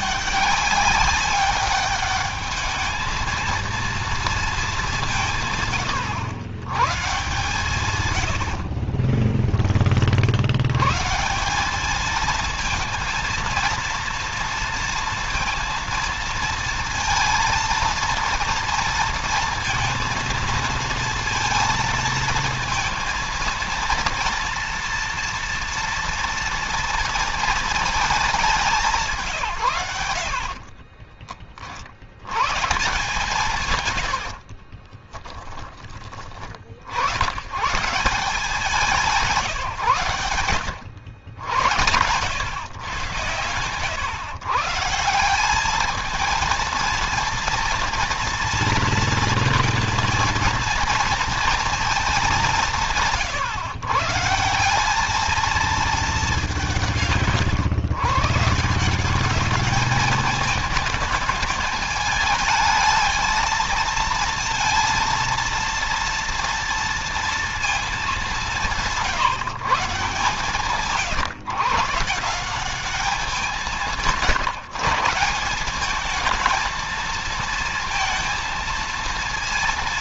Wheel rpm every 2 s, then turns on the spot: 200, 220, 170, 130, 40, 140, 230, 230, 230, 230, 230, 230, 240, 230, 170, 20, 140, 20, 80, 170, 90, 110, 170, 230, 230, 230, 160, 200, 160, 190, 210, 220, 230, 230, 160, 140, 190, 170, 220, 230.
8-10 30-32 34-36